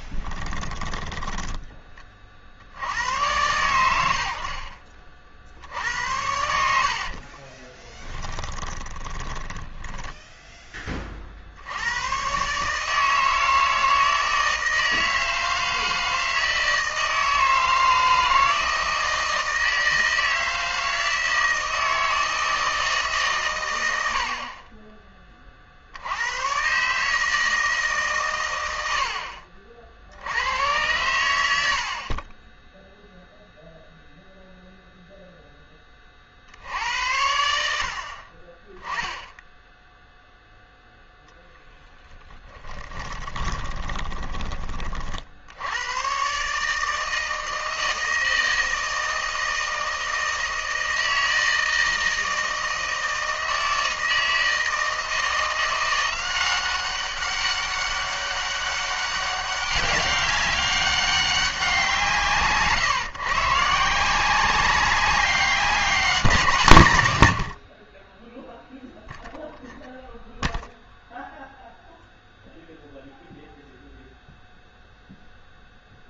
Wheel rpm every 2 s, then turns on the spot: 10, 80, 60, 70, 30, 20, 150, 160, 160, 160, 160, 160, 20, 140, 100, 100, 0, 0, 80, 10, 0, 10, 30, 150, 160, 160, 160, 170, 190, 200, 200, 140, 190, 150, 0, 0, 0, 0.
0-2 6-10 42-44